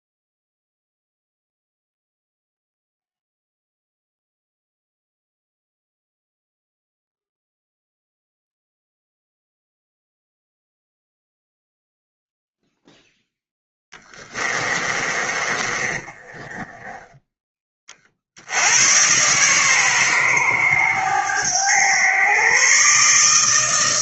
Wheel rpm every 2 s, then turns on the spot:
0, 0, 0, 0, 0, 0, 0, 20, 20, 60, 110, 120.
14-18